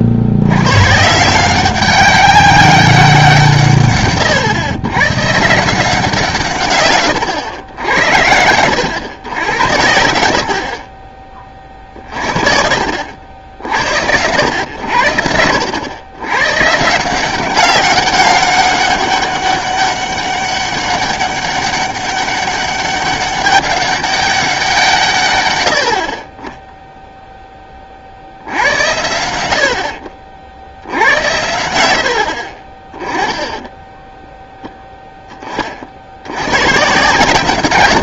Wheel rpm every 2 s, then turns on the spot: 110, 200, 130, 130, 90, 40, 60, 90, 130, 200, 200, 200, 180, 10, 80, 60, 30, 0, 110.
32-34